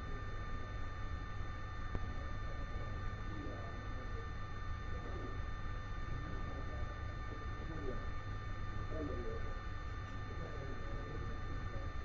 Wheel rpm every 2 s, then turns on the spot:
0, 0, 0, 0, 0, 0.
none